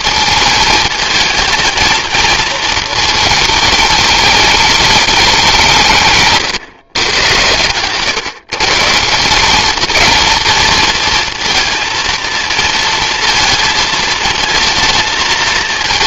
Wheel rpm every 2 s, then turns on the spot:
220, 220, 190, 120, 180, 230, 220, 220.
none